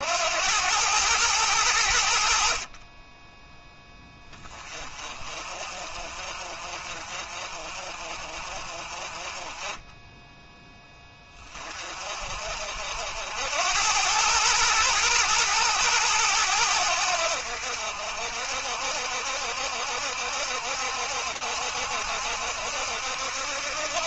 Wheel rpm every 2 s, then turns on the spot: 110, 20, 30, 40, 40, 10, 70, 110, 80, 70, 70, 70.
none